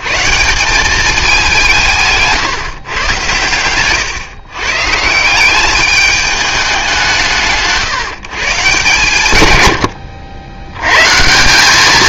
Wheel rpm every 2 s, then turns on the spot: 120, 150, 120, 180, 150, 90.
none